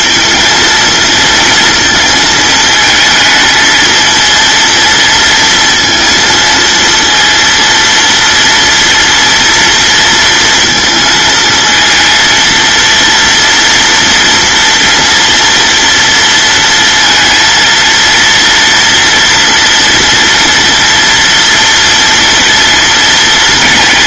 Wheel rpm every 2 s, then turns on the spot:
230, 220, 230, 230, 230, 220, 230, 240, 230, 230, 230, 230.
none